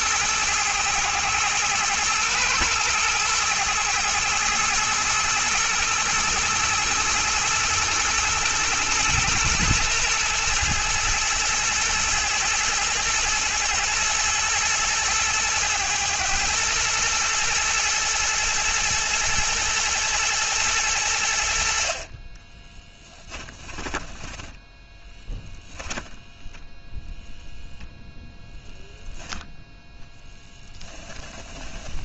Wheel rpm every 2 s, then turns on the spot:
110, 120, 110, 110, 120, 110, 110, 110, 120, 120, 100, 10, 10, 0, 0, 20.
22-26 30-32